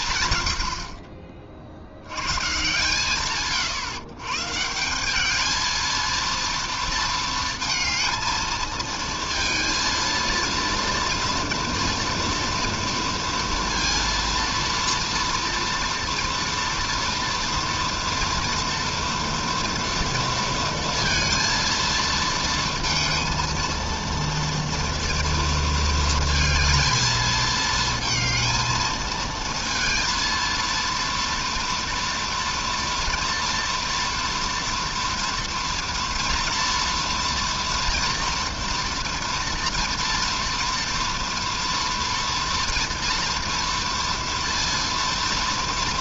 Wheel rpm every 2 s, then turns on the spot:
40, 130, 210, 220, 230, 230, 230, 230, 230, 230, 230, 230, 230, 220, 230, 230, 230, 230, 230, 230, 230, 230, 230.
none